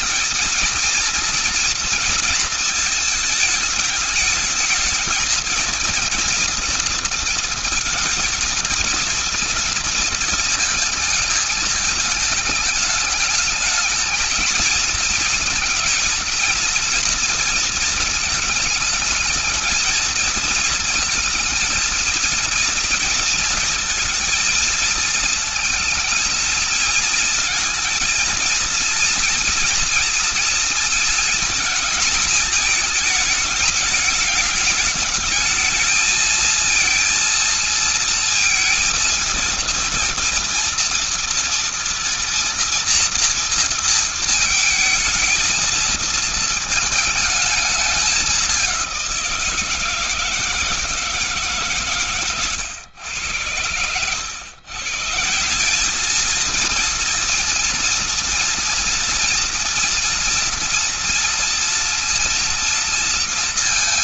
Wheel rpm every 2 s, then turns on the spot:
200, 230, 220, 230, 230, 230, 210, 220, 230, 220, 230, 230, 230, 220, 230, 230, 230, 210, 220, 230, 230, 230, 220, 220, 200, 150, 130, 110, 220, 230, 230, 230.
none